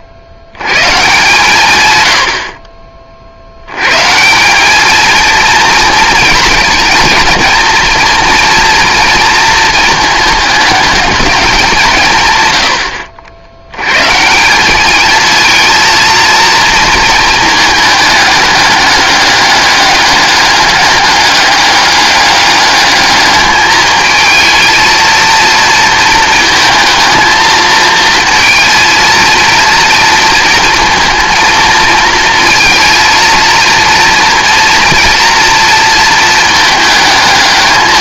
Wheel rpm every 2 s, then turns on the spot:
120, 50, 200, 220, 230, 220, 110, 190, 230, 200, 200, 210, 220, 220, 230, 230, 230, 230, 220.
none